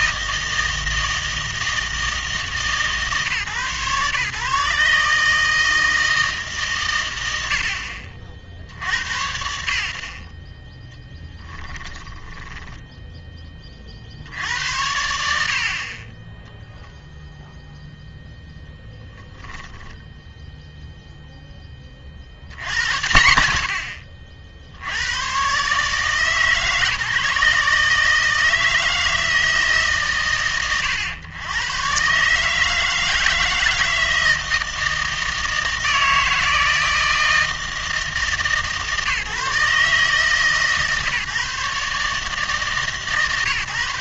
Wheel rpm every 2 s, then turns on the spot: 160, 140, 150, 140, 70, 20, 10, 80, 10, 0, 0, 90, 70, 150, 160, 100, 150, 160, 160, 140, 150, 150.
12-14